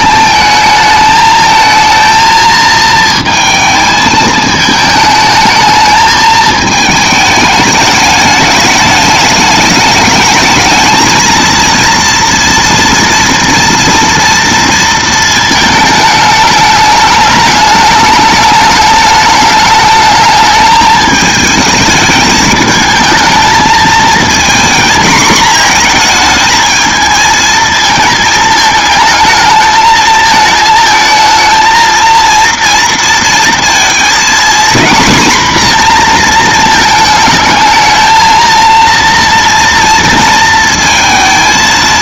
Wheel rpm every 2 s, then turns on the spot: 220, 220, 220, 220, 210, 220, 230, 230, 210, 210, 210, 220, 230, 220, 220, 220, 230, 240, 220, 230, 230.
none